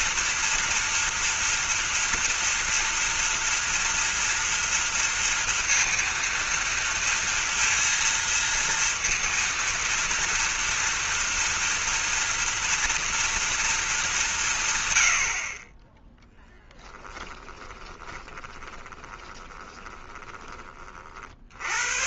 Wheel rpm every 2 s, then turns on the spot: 230, 230, 230, 230, 230, 230, 230, 110, 10, 20, 40.
16-20